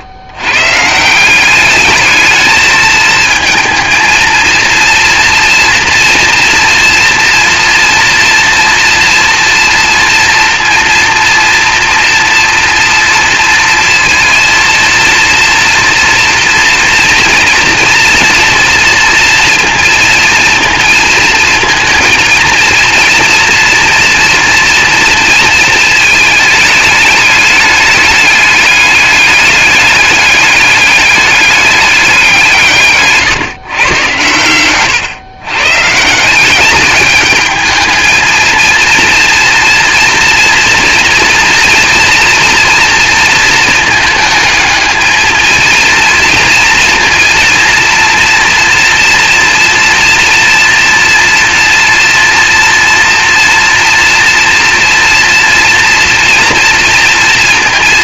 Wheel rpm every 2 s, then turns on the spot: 140, 220, 230, 230, 240, 230, 230, 230, 240, 230, 230, 230, 230, 210, 210, 210, 160, 110, 190, 230, 230, 230, 220, 230, 230, 230, 240, 230, 230.
none